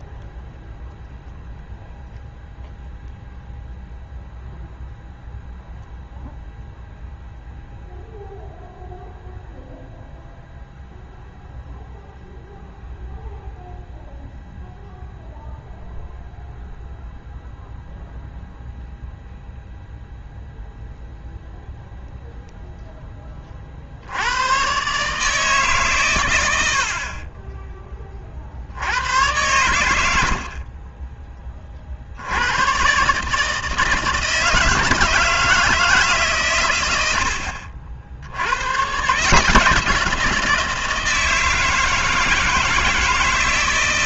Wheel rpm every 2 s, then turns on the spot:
0, 0, 0, 0, 0, 0, 0, 0, 0, 0, 0, 10, 120, 80, 70, 50, 120, 170, 110, 90, 170, 160.
none